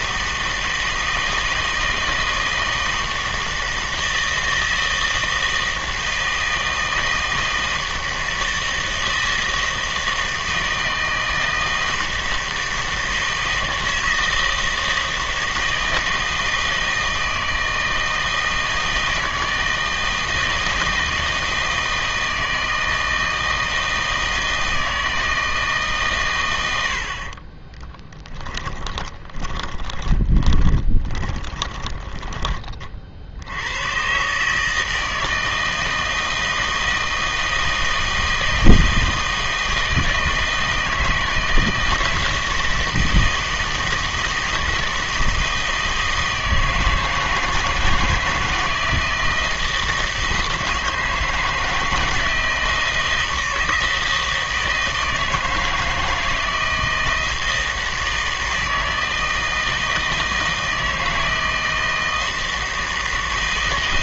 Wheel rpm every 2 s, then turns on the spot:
160, 160, 160, 160, 160, 160, 160, 160, 160, 160, 160, 160, 160, 80, 20, 20, 20, 150, 160, 160, 160, 160, 160, 160, 160, 160, 160, 160, 170, 160, 160, 160.
28-32